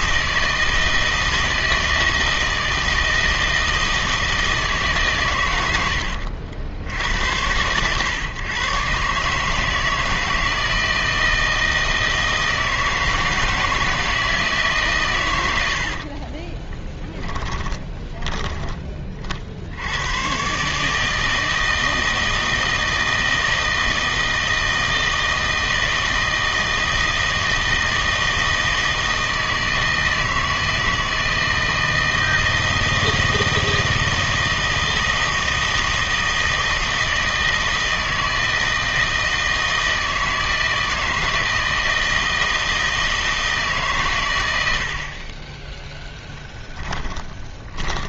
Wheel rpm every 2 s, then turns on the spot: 160, 160, 160, 80, 130, 160, 160, 150, 20, 20, 140, 160, 160, 160, 160, 160, 160, 160, 160, 160, 160, 160, 90, 10.
16-18 46-48